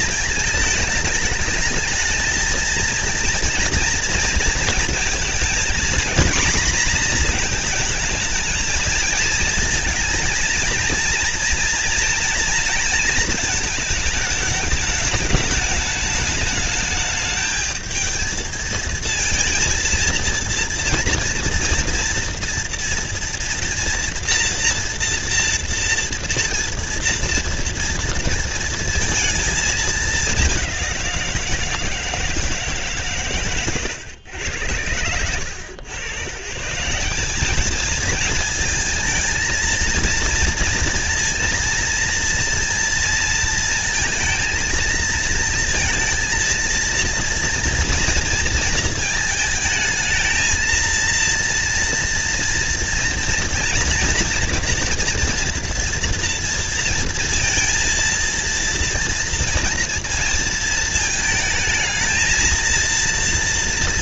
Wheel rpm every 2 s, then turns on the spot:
220, 220, 230, 240, 220, 230, 230, 220, 210, 220, 230, 230, 240, 230, 230, 200, 160, 100, 140, 220, 230, 230, 230, 230, 230, 220, 240, 240, 230, 230, 230, 230.
none